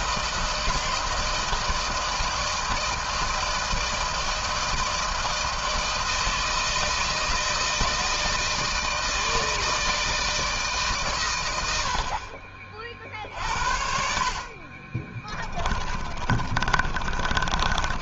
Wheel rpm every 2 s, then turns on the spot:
160, 160, 160, 160, 160, 120, 50, 30, 30.
14-18